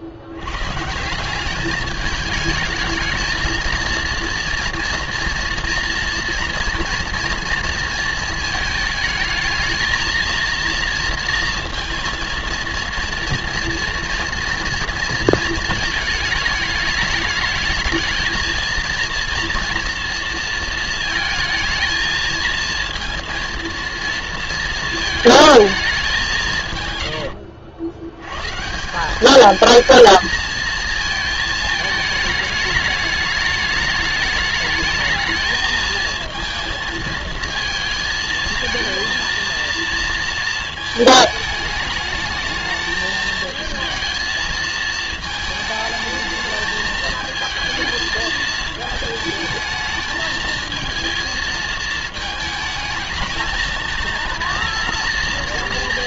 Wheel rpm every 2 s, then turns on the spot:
100, 210, 240, 230, 220, 230, 230, 230, 210, 230, 230, 220, 230, 160, 140, 220, 210, 210, 230, 230, 230, 220, 220, 220, 220, 230, 220, 230.
none